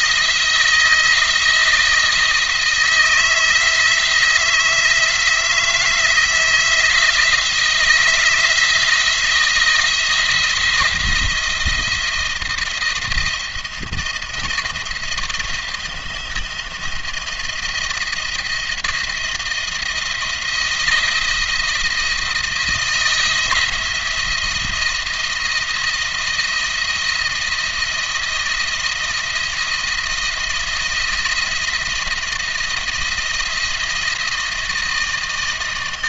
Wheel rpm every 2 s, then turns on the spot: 170, 160, 160, 160, 170, 170, 170, 170, 170, 170, 170, 170, 170, 170, 170, 170, 170, 170.
none